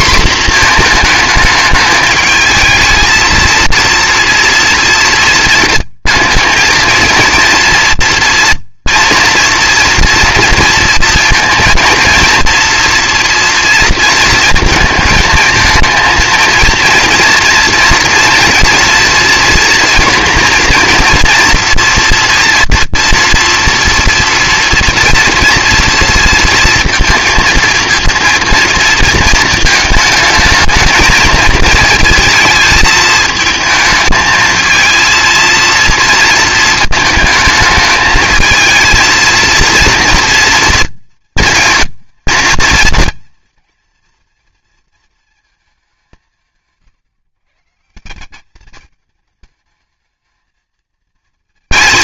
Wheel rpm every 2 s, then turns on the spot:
230, 220, 230, 220, 230, 230, 230, 220, 230, 230, 230, 230, 230, 230, 230, 220, 220, 230, 220, 220, 230, 230, 230, 150, 210, 220.
none